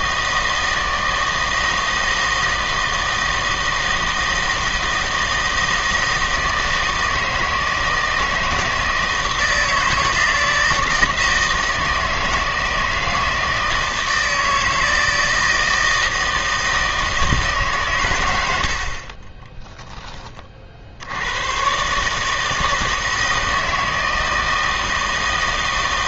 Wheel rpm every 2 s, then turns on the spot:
160, 160, 160, 160, 160, 160, 160, 160, 160, 60, 50, 160, 160.
none